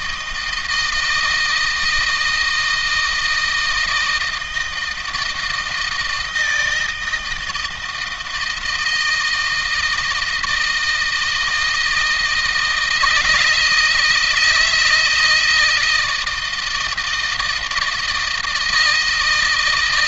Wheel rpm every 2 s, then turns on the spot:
160, 160, 160, 160, 160, 160, 160, 170, 160, 160.
none